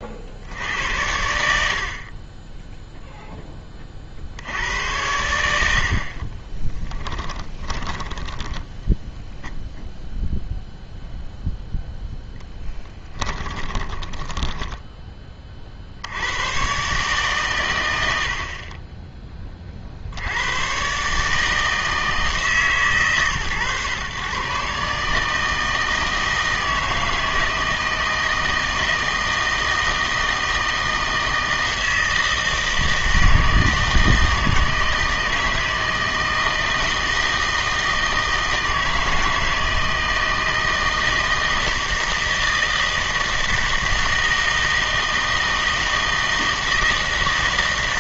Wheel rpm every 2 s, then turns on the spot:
70, 10, 90, 20, 10, 0, 0, 10, 110, 60, 100, 150, 130, 160, 160, 160, 160, 160, 160, 160, 160, 160, 160, 160.
6-10 14-16